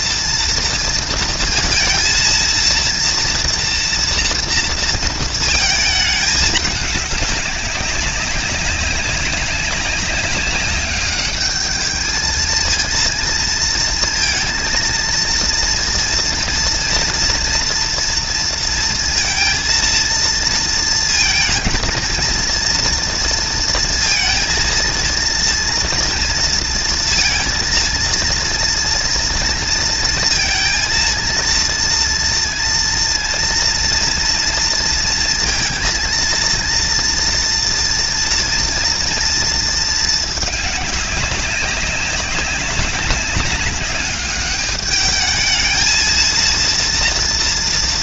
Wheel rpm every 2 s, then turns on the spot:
230, 230, 230, 210, 190, 200, 230, 230, 230, 230, 230, 230, 230, 230, 240, 230, 230, 230, 230, 230, 200, 190, 210, 230.
none